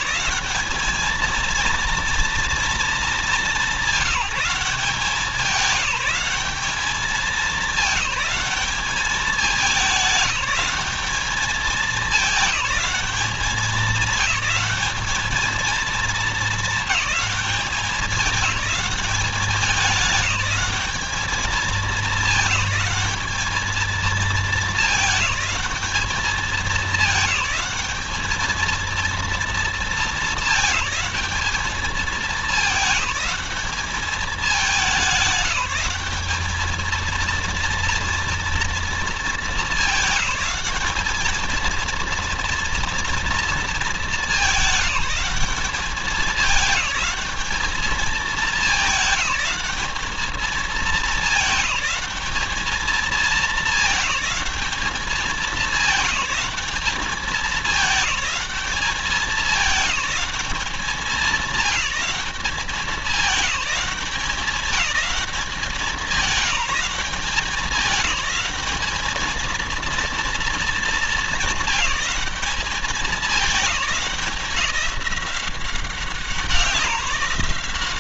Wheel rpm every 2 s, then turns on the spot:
210, 230, 190, 210, 210, 200, 210, 210, 220, 200, 210, 210, 220, 200, 220, 220, 210, 200, 220, 230, 200, 230, 210, 210, 210, 220, 220, 210, 210, 200, 190, 190, 200, 190, 210, 220, 200, 190, 190.
none